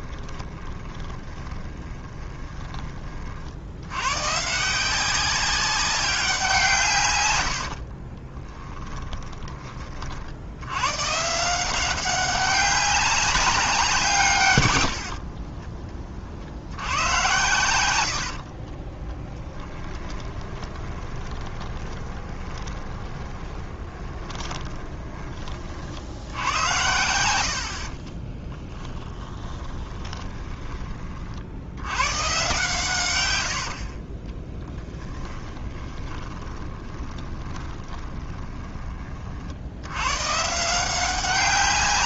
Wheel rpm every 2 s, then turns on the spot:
20, 20, 180, 150, 20, 110, 200, 90, 90, 30, 20, 20, 20, 90, 10, 30, 120, 10, 20, 40, 160.
0-2 8-10 18-30 34-38